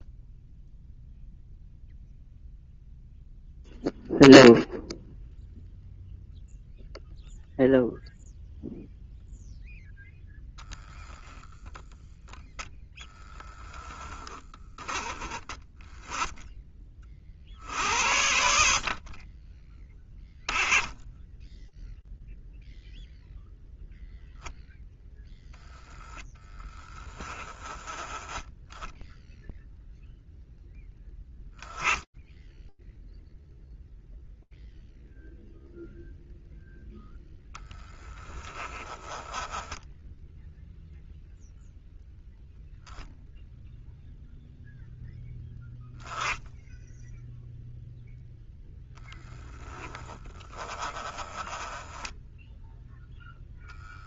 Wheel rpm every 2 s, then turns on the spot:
0, 0, 0, 0, 0, 0, 0, 10, 10, 70, 10, 0, 0, 10, 10, 0, 0, 0, 0, 10, 0, 0, 0, 0, 10, 10, 0.
none